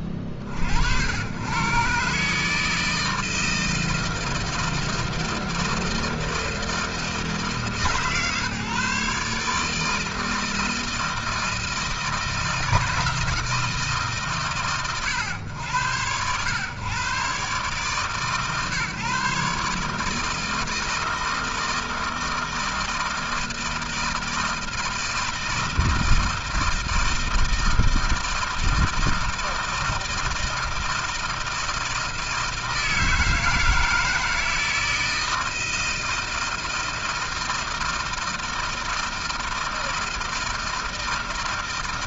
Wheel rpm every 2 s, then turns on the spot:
60, 150, 160, 160, 140, 160, 160, 130, 120, 140, 160, 160, 160, 160, 160, 160, 160, 160, 160, 160, 160.
none